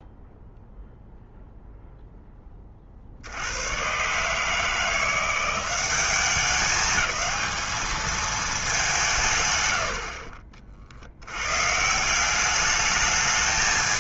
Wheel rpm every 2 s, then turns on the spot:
0, 40, 160, 210, 210, 60, 210.
none